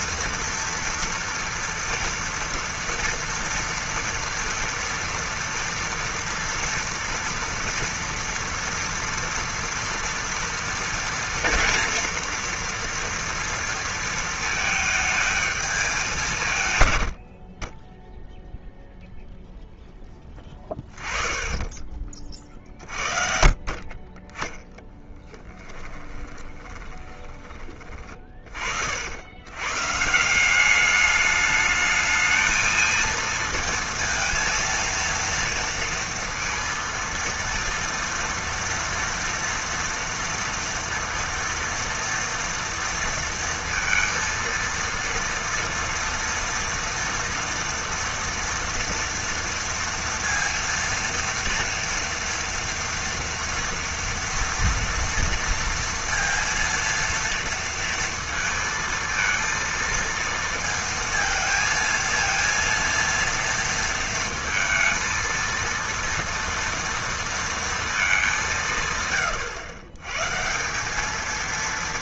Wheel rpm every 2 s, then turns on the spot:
230, 230, 230, 240, 230, 230, 230, 220, 110, 0, 20, 40, 10, 20, 70, 210, 220, 230, 230, 230, 230, 230, 230, 230, 230, 230, 230, 230, 230, 230, 230, 230, 230, 230, 170, 170.
20-22 24-28